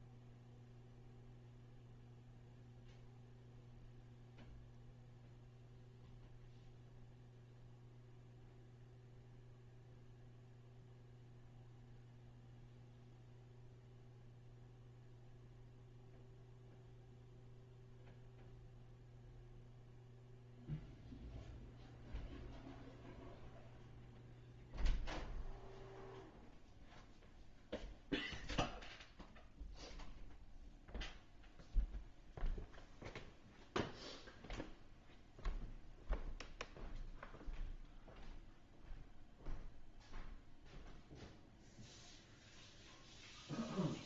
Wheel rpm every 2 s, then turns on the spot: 0, 0, 0, 0, 0, 0, 0, 0, 0, 0, 0, 0, 0, 0, 0, 0, 0, 0, 0, 0, 0, 0.
none